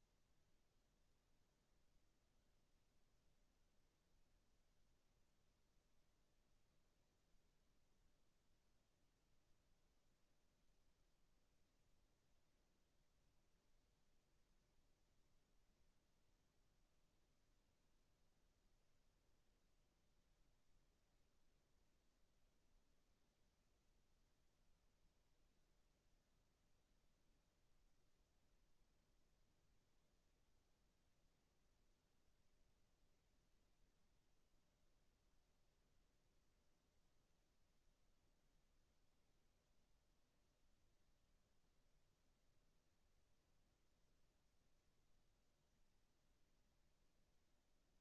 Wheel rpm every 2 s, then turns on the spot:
0, 0, 0, 0, 0, 0, 0, 0, 0, 0, 0, 0, 0, 0, 0, 0, 0, 0, 0, 0, 0, 0, 0, 0.
none